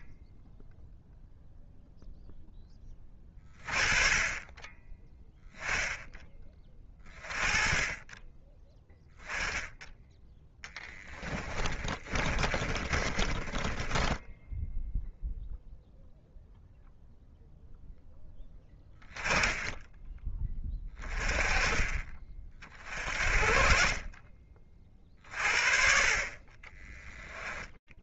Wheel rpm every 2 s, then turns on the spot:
20, 10, 20, 20, 10, 10, 30, 0, 0, 20, 30, 40, 40, 20.
10-14 26-28